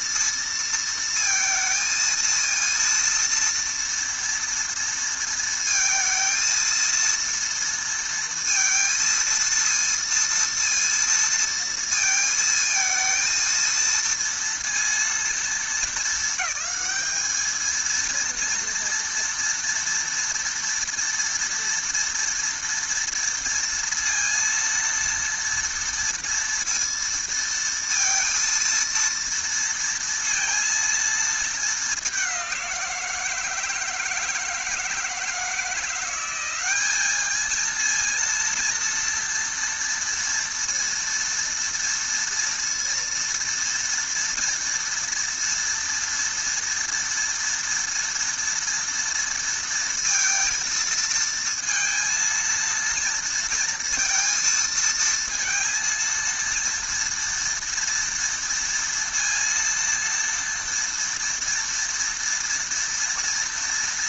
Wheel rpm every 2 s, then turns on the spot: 230, 230, 230, 230, 230, 230, 230, 230, 220, 230, 230, 230, 230, 230, 230, 230, 170, 160, 210, 230, 230, 230, 230, 230, 230, 230, 230, 230, 230, 230, 230, 230.
none